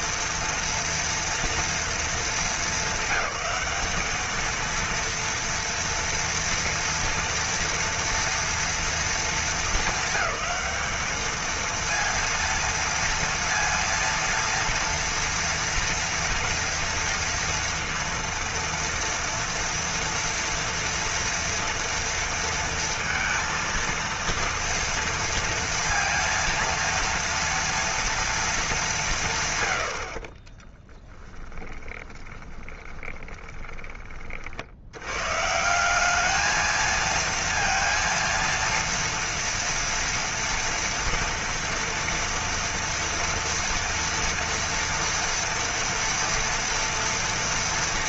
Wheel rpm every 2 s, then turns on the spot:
230, 220, 220, 230, 230, 200, 230, 230, 240, 230, 230, 230, 230, 230, 230, 30, 20, 50, 210, 230, 230, 230, 230, 230.
30-34